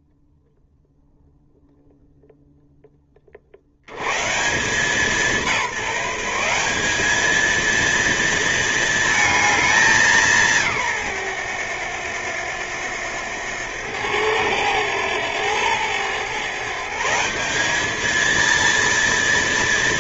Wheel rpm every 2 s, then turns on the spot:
0, 30, 190, 210, 220, 130, 100, 110, 170, 230.
none